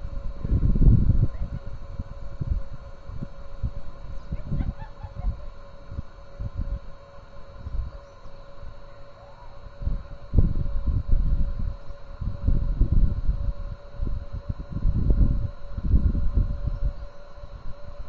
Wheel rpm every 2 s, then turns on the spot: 0, 0, 0, 0, 0, 0, 0, 0, 0.
none